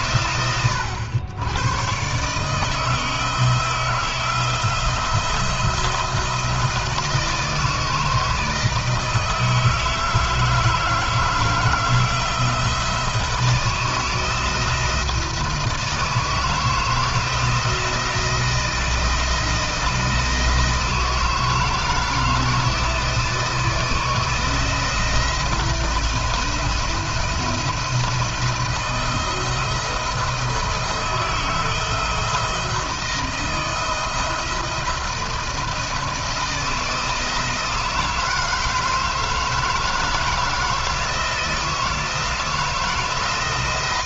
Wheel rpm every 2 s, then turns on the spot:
100, 160, 160, 160, 160, 160, 160, 170, 160, 160, 160, 160, 160, 170, 160, 160, 170, 170, 160, 160, 160, 160.
none